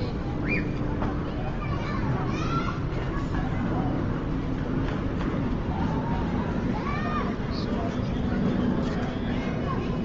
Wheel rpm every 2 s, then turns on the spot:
0, 0, 0, 0, 0.
none